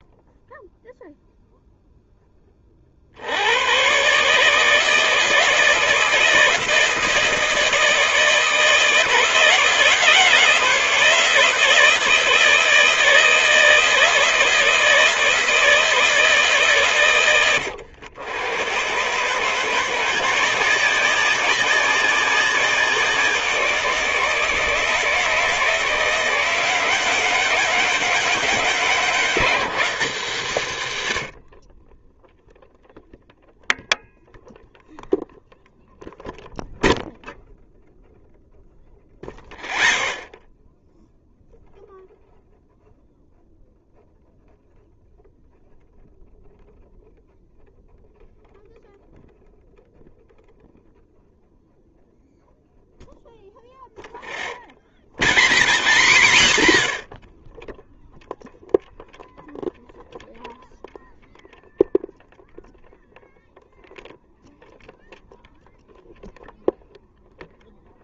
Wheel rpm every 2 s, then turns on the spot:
0, 70, 160, 160, 160, 160, 160, 160, 120, 130, 190, 180, 160, 180, 190, 110, 0, 0, 0, 0, 0, 0, 0, 0, 0, 0, 0, 0, 0, 0, 0, 0, 0, 0.
none